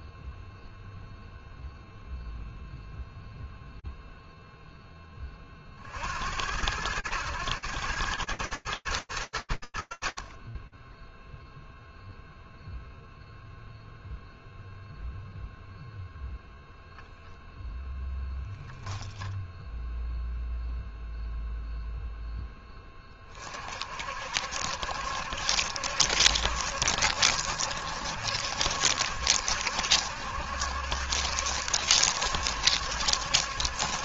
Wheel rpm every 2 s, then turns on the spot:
0, 0, 80, 110, 100, 0, 0, 0, 0, 0, 0, 50, 70, 70, 70, 70, 70.
none